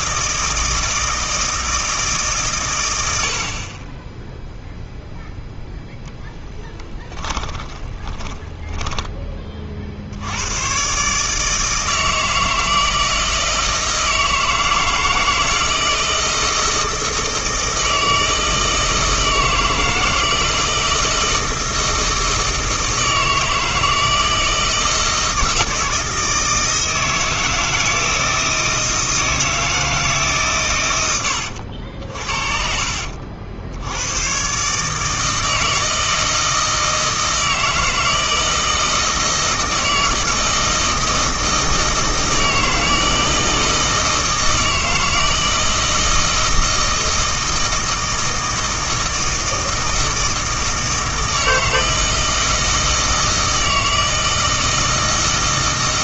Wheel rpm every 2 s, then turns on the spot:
160, 120, 0, 10, 10, 110, 160, 160, 160, 160, 160, 160, 160, 160, 160, 120, 50, 140, 160, 160, 160, 160, 160, 160, 160, 160, 160, 160.
6-10